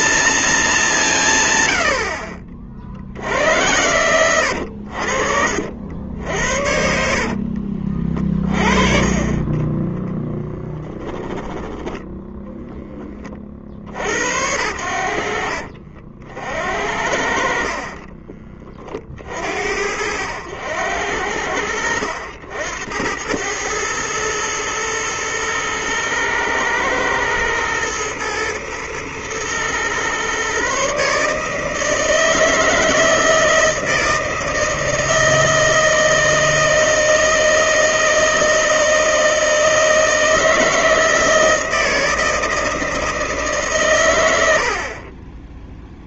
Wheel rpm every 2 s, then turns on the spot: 190, 60, 80, 60, 30, 10, 20, 70, 70, 30, 80, 90, 110, 110, 110, 140, 160, 160, 160, 160, 160, 160, 30.
6-8 10-12